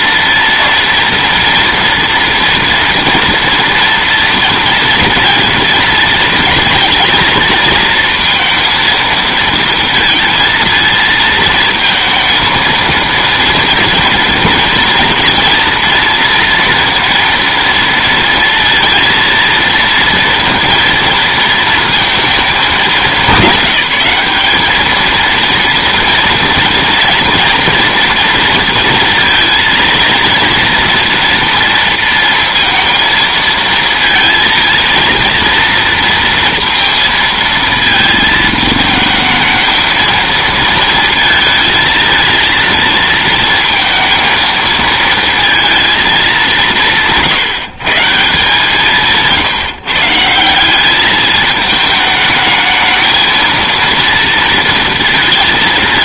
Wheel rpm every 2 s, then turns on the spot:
230, 230, 230, 220, 230, 230, 230, 230, 230, 230, 230, 210, 210, 230, 230, 230, 230, 230, 230, 220, 230, 230, 220, 180, 170, 200, 220, 230.
none